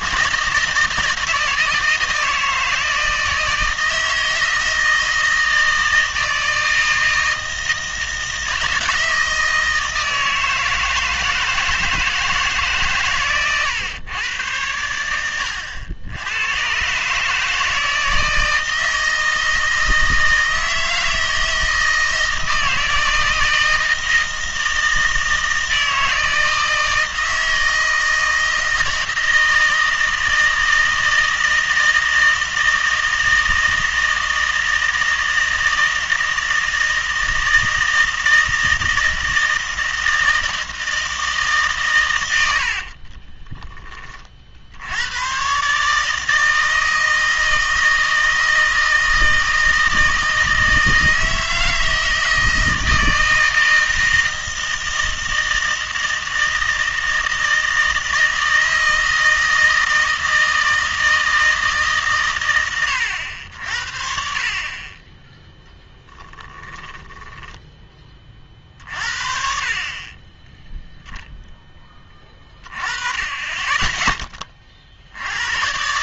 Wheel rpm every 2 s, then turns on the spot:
160, 160, 160, 160, 160, 160, 150, 100, 120, 160, 160, 160, 160, 160, 160, 160, 160, 160, 160, 160, 160, 60, 70, 160, 160, 160, 160, 160, 160, 160, 160, 110, 40, 20, 40, 0, 20, 40.
42-44 66-68